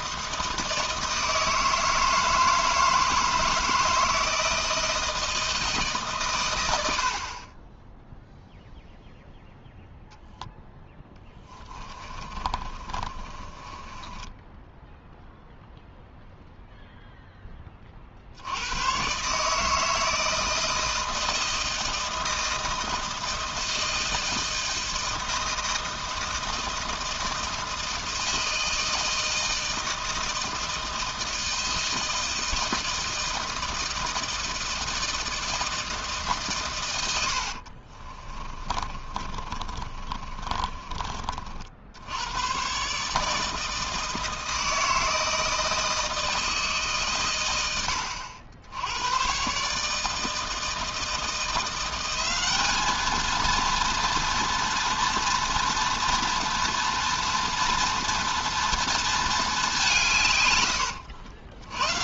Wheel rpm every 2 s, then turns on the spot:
160, 160, 160, 100, 0, 0, 30, 10, 0, 90, 160, 160, 160, 160, 160, 160, 160, 160, 130, 30, 30, 120, 160, 150, 80, 160, 200, 230, 230, 230, 100.
12-16 38-42